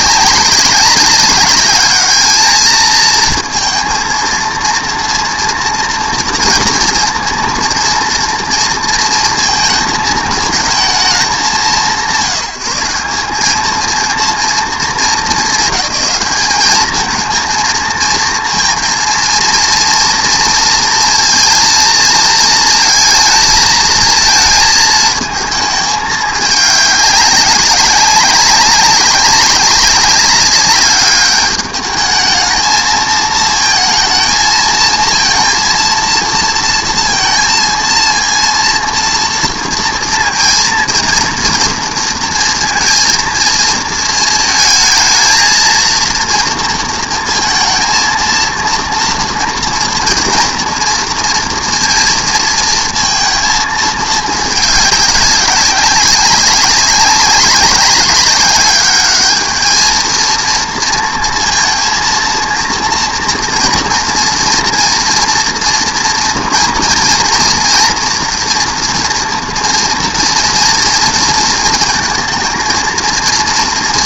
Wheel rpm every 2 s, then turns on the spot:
190, 220, 230, 230, 230, 220, 200, 220, 210, 230, 230, 230, 220, 200, 190, 200, 220, 230, 230, 230, 230, 230, 220, 230, 230, 230, 230, 210, 190, 200, 230, 230, 230, 230, 240, 230, 230.
none